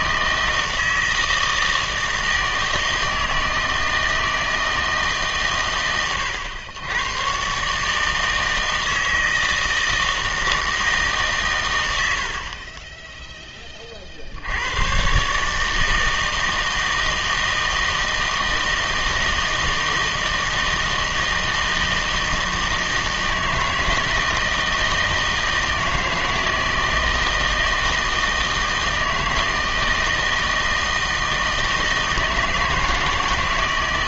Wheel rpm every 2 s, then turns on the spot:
160, 160, 160, 100, 160, 160, 30, 80, 160, 160, 160, 160, 160, 160, 160, 160, 160.
none